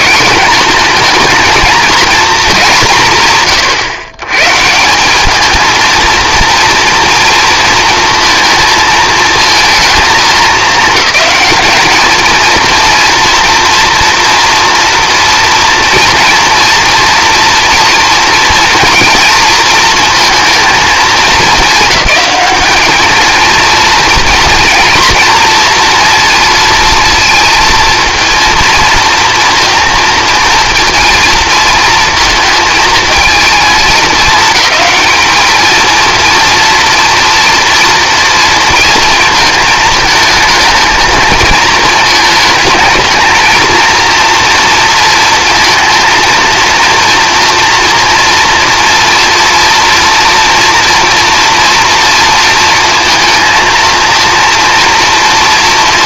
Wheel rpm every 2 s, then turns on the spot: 220, 200, 150, 230, 220, 200, 230, 230, 240, 240, 220, 200, 240, 230, 240, 230, 230, 220, 230, 230, 220, 220, 230, 230, 230, 230, 230, 240.
none